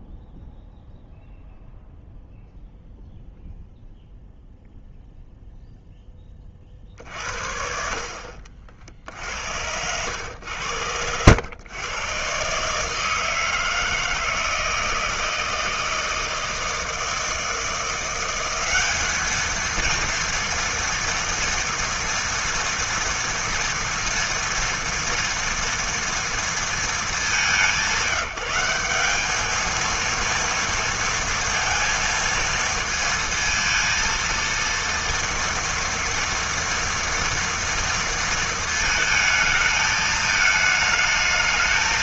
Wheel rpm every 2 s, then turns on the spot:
0, 0, 0, 70, 70, 90, 160, 160, 160, 210, 230, 230, 230, 200, 200, 230, 230, 230, 230, 220, 220.
8-10